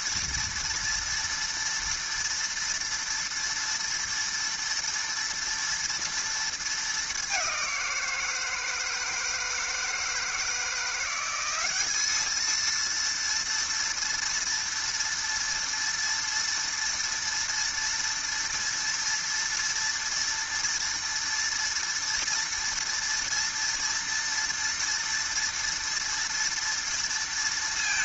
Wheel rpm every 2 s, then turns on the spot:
240, 230, 230, 220, 160, 170, 230, 230, 230, 230, 230, 230, 230, 230.
none